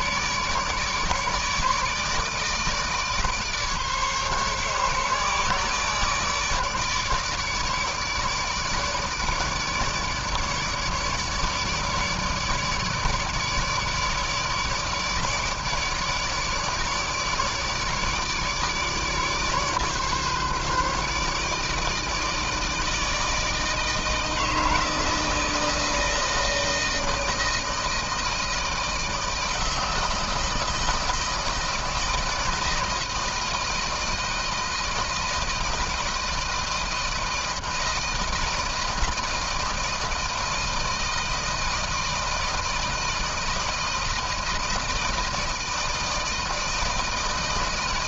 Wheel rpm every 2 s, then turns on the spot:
150, 150, 140, 150, 150, 150, 150, 150, 150, 150, 140, 160, 160, 160, 160, 160, 160, 160, 160, 160, 160, 160, 160, 160.
none